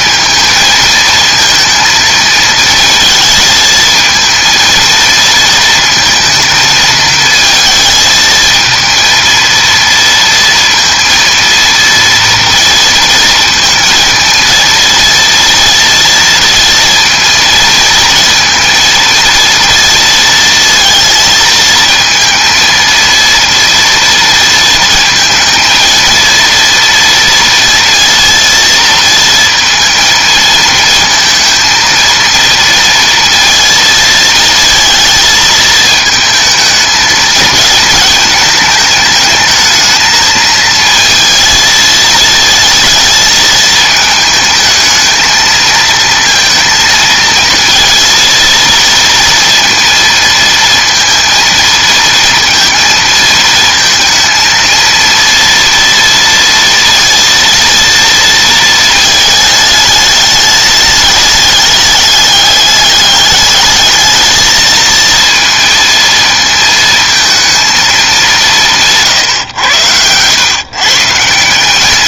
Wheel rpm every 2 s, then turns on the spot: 220, 220, 230, 220, 230, 230, 230, 230, 230, 230, 230, 230, 220, 230, 230, 220, 230, 230, 220, 210, 220, 220, 220, 230, 230, 230, 230, 230, 230, 220, 210, 210, 220, 220, 170, 130.
none